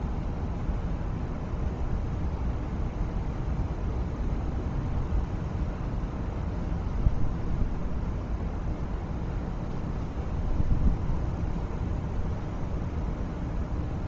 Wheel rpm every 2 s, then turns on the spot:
0, 0, 0, 0, 0, 0, 0.
none